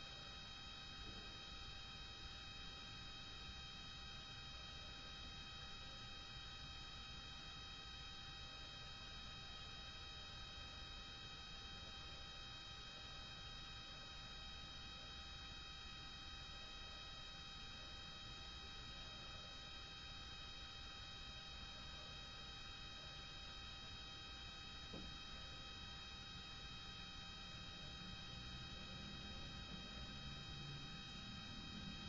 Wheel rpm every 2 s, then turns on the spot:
0, 0, 0, 0, 0, 0, 0, 0, 0, 0, 0, 0, 0, 0, 0, 0.
none